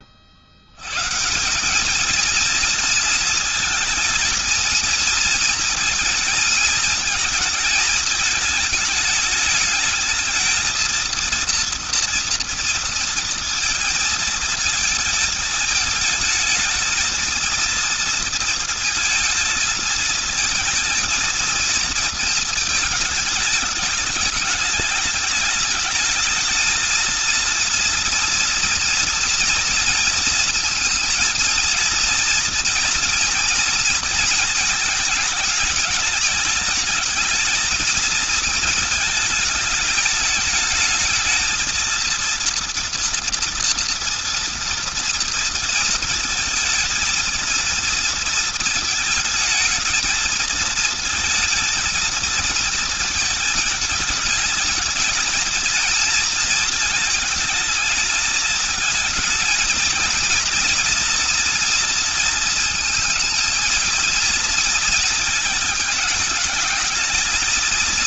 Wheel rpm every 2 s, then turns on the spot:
80, 230, 230, 230, 220, 220, 230, 220, 220, 230, 220, 220, 210, 220, 230, 230, 230, 220, 210, 220, 220, 230, 230, 220, 230, 220, 230, 210, 220, 220, 230, 230, 230, 220.
none